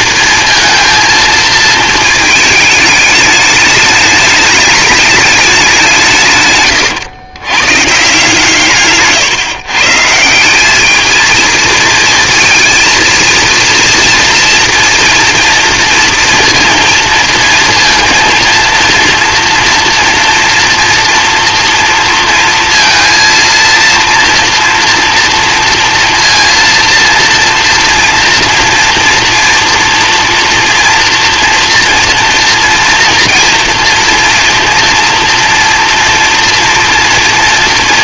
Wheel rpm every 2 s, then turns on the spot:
230, 210, 210, 120, 140, 200, 230, 230, 230, 230, 230, 230, 230, 230, 230, 230, 230, 230, 230.
6-8